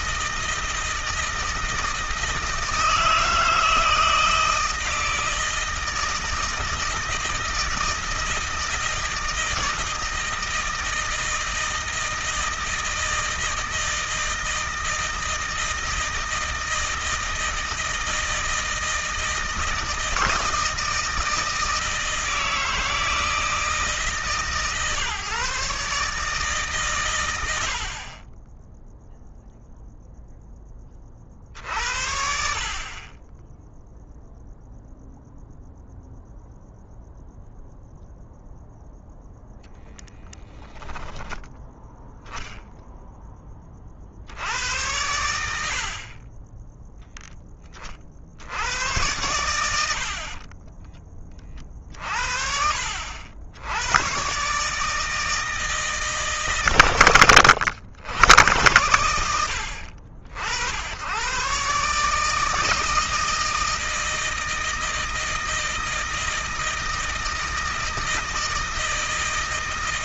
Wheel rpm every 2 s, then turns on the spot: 160, 160, 160, 160, 160, 160, 160, 160, 160, 160, 160, 160, 140, 140, 10, 20, 40, 0, 0, 0, 10, 0, 80, 10, 90, 20, 60, 140, 130, 100, 80, 160, 160, 160, 160.
50-52